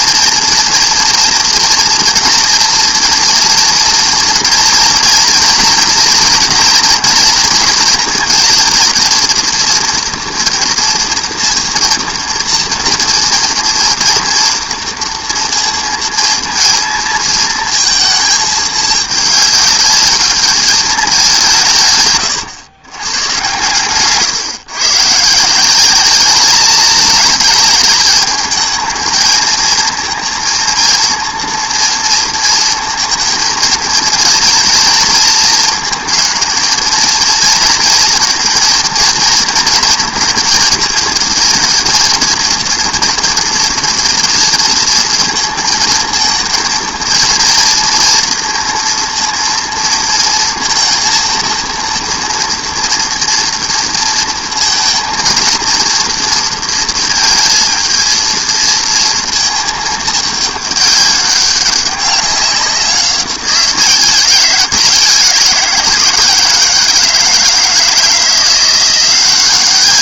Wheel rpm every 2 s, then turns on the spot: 230, 230, 230, 240, 230, 230, 230, 230, 230, 220, 210, 120, 130, 210, 220, 230, 230, 230, 220, 230, 230, 230, 230, 220, 230, 230, 230, 230, 230, 230, 210, 190, 180, 160, 170.
none